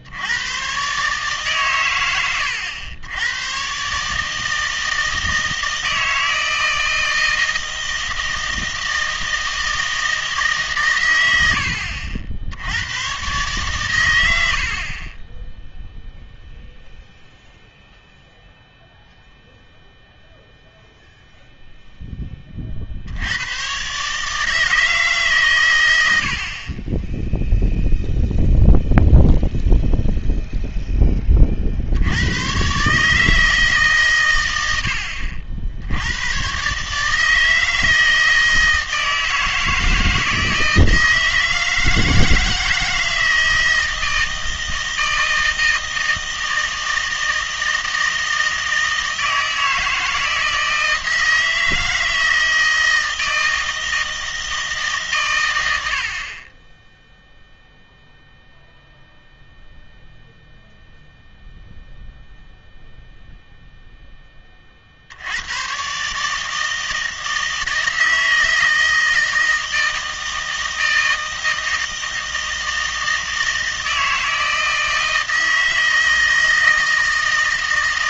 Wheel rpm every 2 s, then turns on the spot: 120, 90, 160, 160, 160, 140, 80, 70, 0, 0, 0, 40, 160, 40, 0, 0, 130, 90, 140, 160, 160, 160, 160, 160, 160, 160, 160, 160, 20, 0, 0, 0, 40, 160, 160, 160, 160, 160, 160.
none